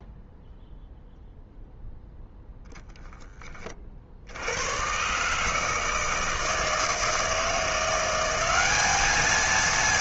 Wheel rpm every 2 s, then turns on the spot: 0, 0, 90, 160, 200.
none